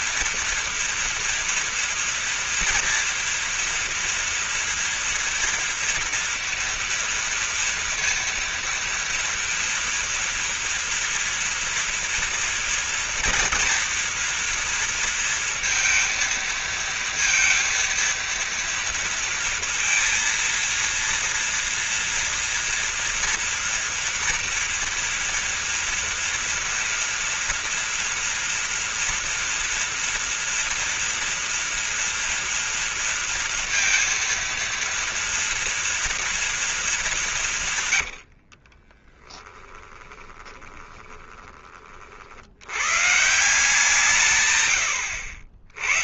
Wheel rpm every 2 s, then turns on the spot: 240, 230, 230, 230, 230, 230, 230, 230, 230, 230, 230, 230, 230, 230, 230, 230, 230, 230, 220, 50, 20, 100, 110.
38-42 44-46